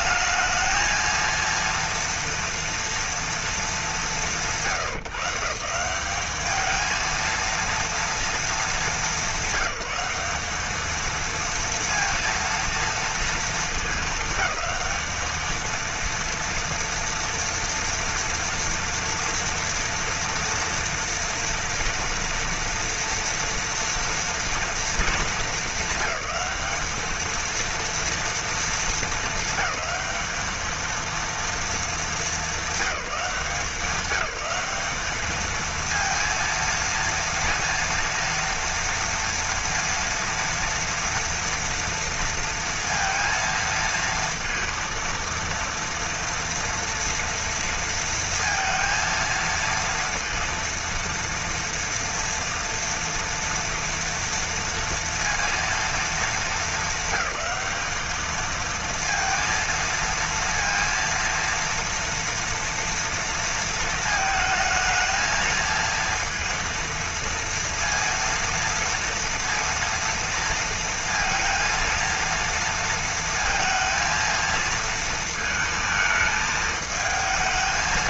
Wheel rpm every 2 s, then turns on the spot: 220, 230, 170, 210, 220, 200, 230, 200, 230, 230, 230, 230, 230, 210, 230, 220, 200, 190, 230, 230, 240, 230, 230, 230, 230, 230, 230, 230, 220, 220, 230, 230, 220, 230, 230, 230, 230, 230, 220.
none